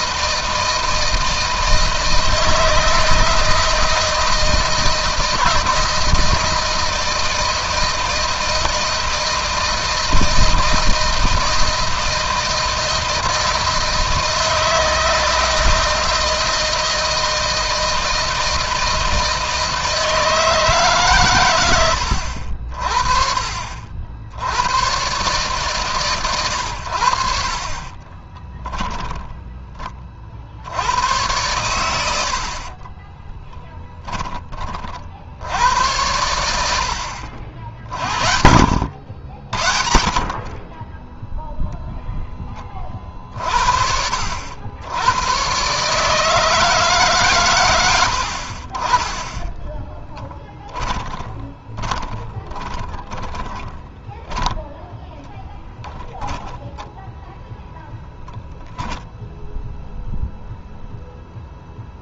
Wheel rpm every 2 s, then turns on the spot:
160, 160, 160, 160, 160, 160, 160, 160, 160, 160, 150, 50, 110, 100, 20, 70, 40, 40, 80, 70, 20, 30, 90, 150, 40, 20, 20, 0, 10, 0, 0.
28-30 32-34 50-54